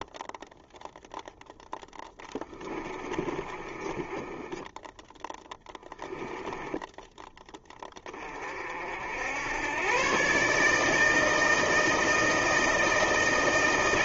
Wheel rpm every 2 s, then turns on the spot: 0, 10, 20, 10, 30, 130, 160.
2-8